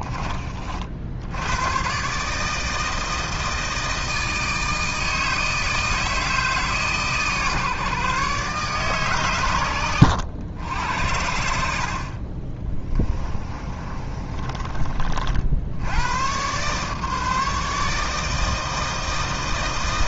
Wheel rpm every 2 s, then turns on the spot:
50, 160, 160, 150, 140, 80, 20, 30, 130, 160.
12-14